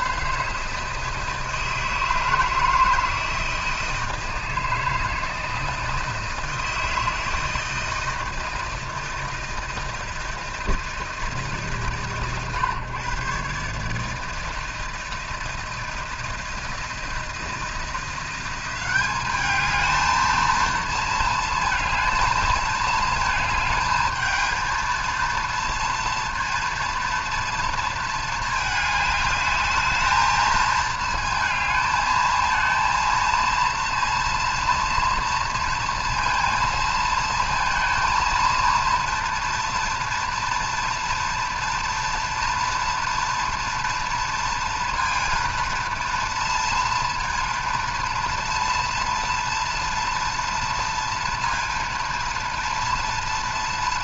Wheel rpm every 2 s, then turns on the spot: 160, 160, 160, 160, 160, 160, 140, 160, 160, 190, 230, 220, 220, 230, 210, 220, 230, 230, 230, 230, 230, 230, 230, 230, 230, 230, 230.
none